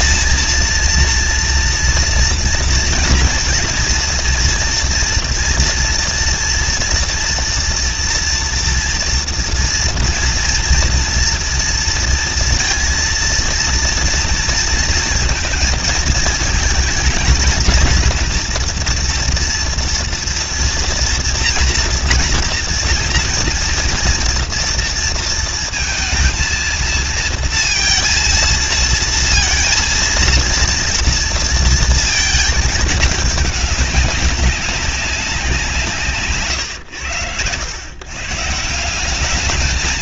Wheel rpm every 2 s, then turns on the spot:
230, 230, 230, 240, 230, 230, 230, 230, 220, 240, 230, 230, 230, 230, 220, 230, 220, 190, 130, 140.
none